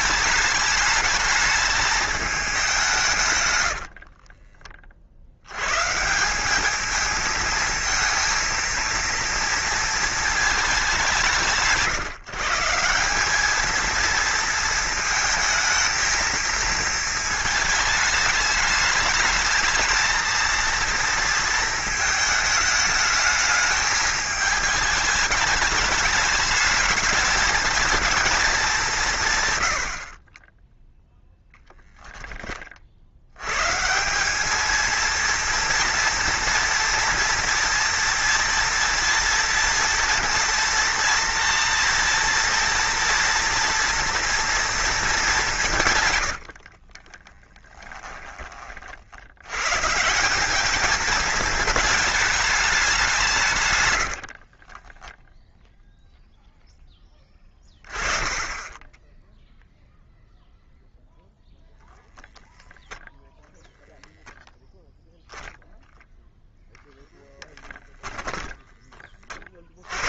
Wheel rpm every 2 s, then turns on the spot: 210, 190, 30, 200, 230, 210, 170, 220, 230, 210, 230, 220, 210, 210, 190, 10, 40, 220, 230, 240, 230, 230, 230, 50, 40, 210, 210, 50, 0, 10, 0, 0, 0, 0, 10.
46-48 54-56